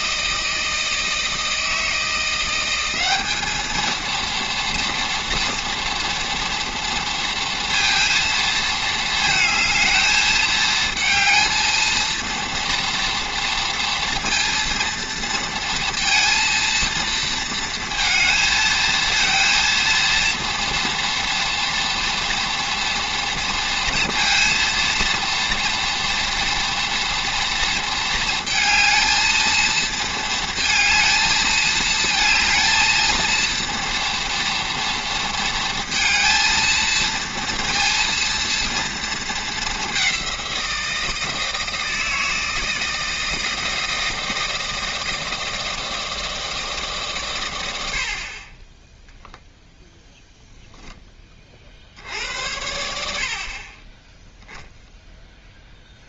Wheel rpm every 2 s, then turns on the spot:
160, 180, 230, 230, 230, 220, 230, 230, 230, 230, 230, 230, 230, 230, 230, 230, 220, 230, 220, 230, 180, 160, 160, 160, 30, 10, 80, 0.
none